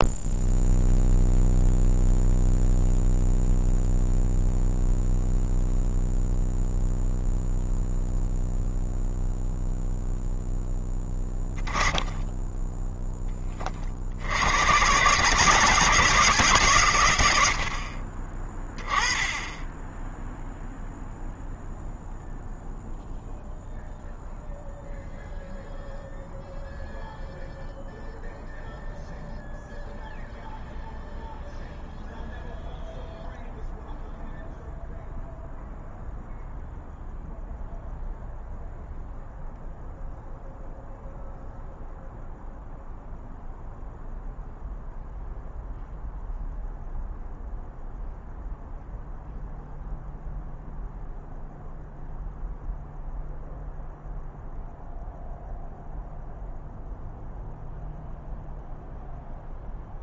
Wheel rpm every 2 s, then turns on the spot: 0, 0, 0, 0, 0, 10, 10, 100, 130, 20, 0, 0, 0, 0, 0, 0, 0, 0, 0, 0, 0, 0, 0, 0, 0, 0, 0, 0, 0, 0.
none